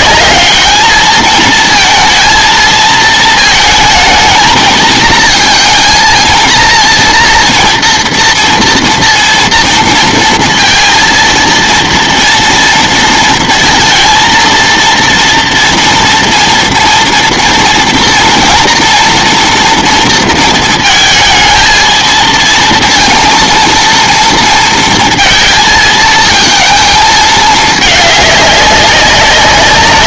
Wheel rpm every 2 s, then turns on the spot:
220, 220, 230, 230, 240, 230, 230, 230, 240, 230, 230, 230, 230, 220, 200.
none